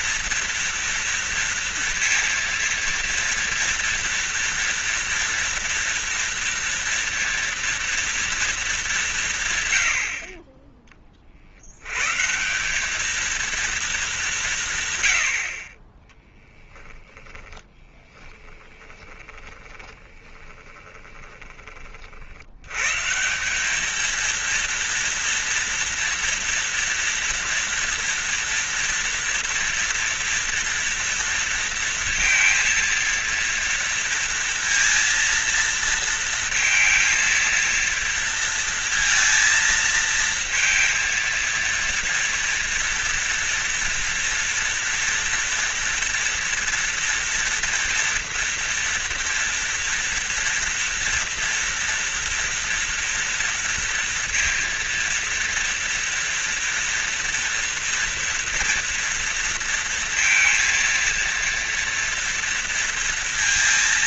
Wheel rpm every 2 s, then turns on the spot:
230, 230, 230, 230, 210, 30, 190, 160, 10, 10, 20, 90, 230, 230, 230, 230, 230, 230, 230, 230, 230, 230, 230, 230, 230, 230, 230, 230, 230, 240, 230, 230.
18-22